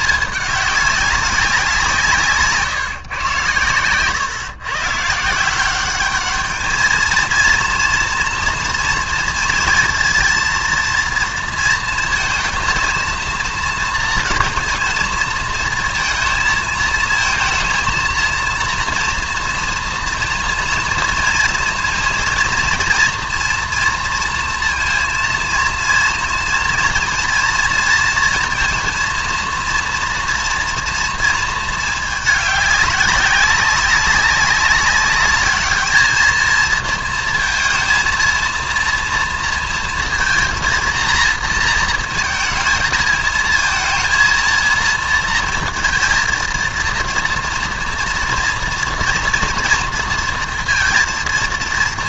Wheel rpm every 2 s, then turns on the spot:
210, 140, 130, 220, 240, 230, 230, 230, 230, 230, 230, 230, 230, 230, 230, 230, 210, 200, 230, 230, 230, 220, 230, 230, 240, 230.
none